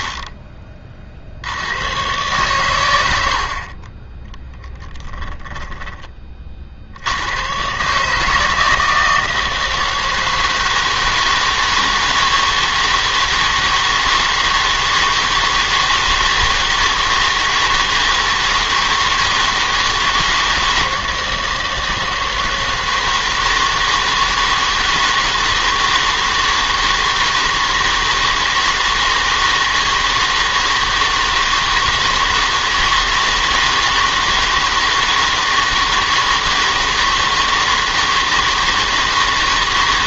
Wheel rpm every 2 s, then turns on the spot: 30, 120, 10, 50, 160, 160, 160, 160, 160, 160, 160, 160, 160, 160, 160, 160, 160, 160, 160, 160.
4-6